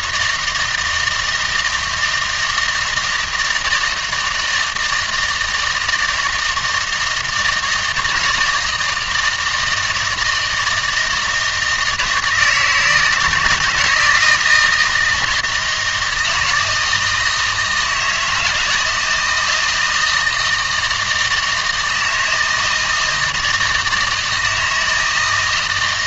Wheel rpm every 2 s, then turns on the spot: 160, 160, 160, 160, 170, 160, 160, 160, 160, 160, 160, 160, 160.
none